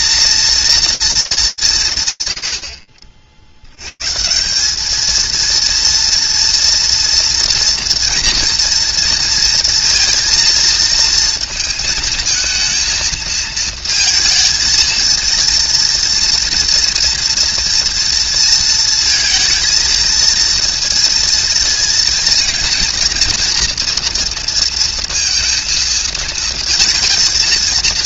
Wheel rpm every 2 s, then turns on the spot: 230, 80, 210, 230, 230, 230, 230, 230, 240, 230, 230, 230, 230, 220.
none